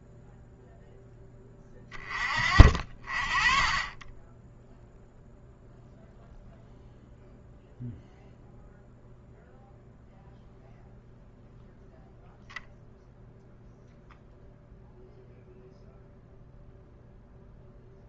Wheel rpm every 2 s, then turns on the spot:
0, 40, 0, 0, 0, 0, 0, 0, 0.
none